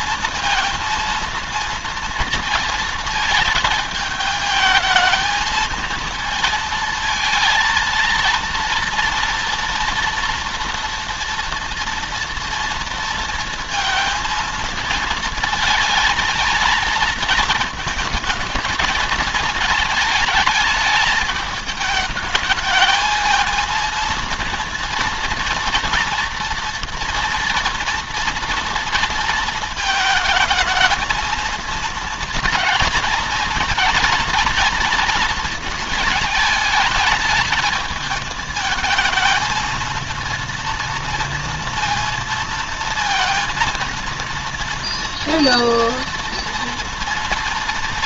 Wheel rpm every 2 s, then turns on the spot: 230, 230, 220, 230, 230, 230, 230, 230, 230, 220, 210, 210, 230, 230, 230, 220, 220, 230, 210, 220, 230, 230, 230, 230.
none